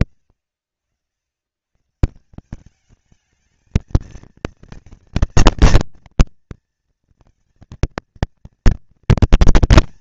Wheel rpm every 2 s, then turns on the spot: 90, 200, 230, 230, 230.
none